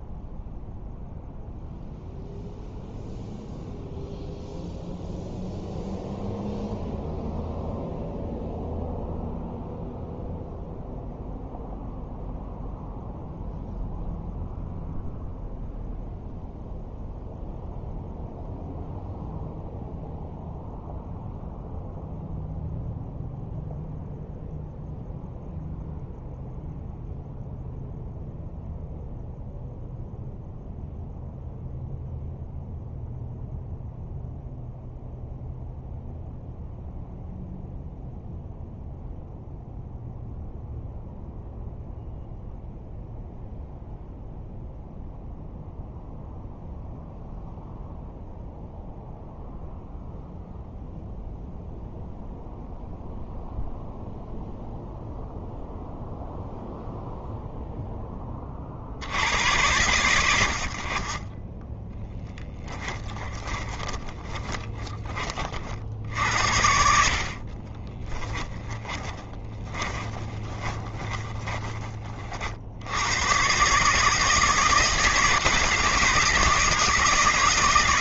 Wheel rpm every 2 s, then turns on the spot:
0, 0, 0, 0, 0, 0, 0, 0, 0, 0, 0, 0, 0, 0, 0, 0, 0, 0, 0, 0, 0, 0, 0, 0, 0, 0, 0, 0, 0, 60, 50, 20, 20, 70, 10, 20, 90, 160, 150.
62-64 66-72